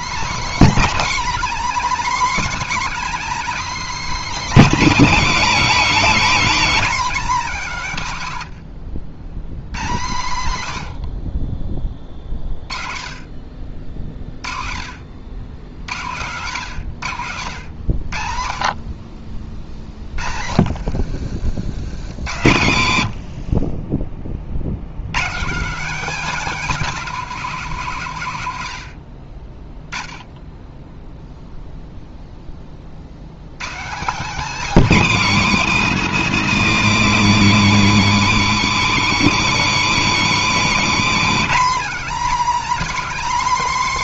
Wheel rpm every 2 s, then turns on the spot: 300, 290, 280, 260, 100, 110, 30, 40, 130, 40, 70, 90, 70, 270, 120, 10, 30, 260, 240, 210, 210, 270.
8-10 20-22